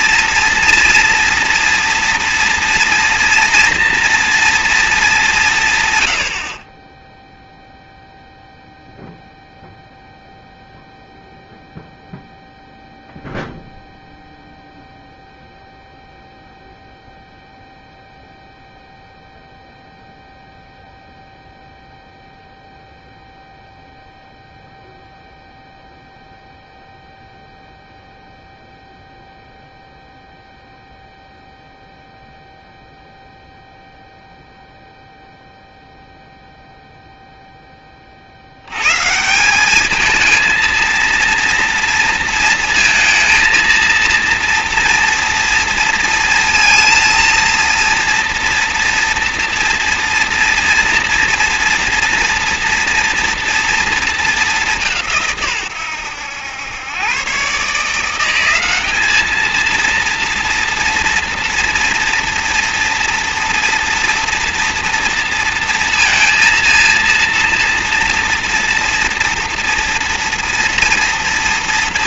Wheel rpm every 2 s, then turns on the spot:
230, 240, 110, 0, 0, 0, 0, 0, 0, 0, 0, 0, 0, 0, 0, 0, 0, 0, 0, 150, 230, 230, 230, 230, 230, 230, 230, 170, 110, 210, 240, 230, 230, 230, 230, 230.
none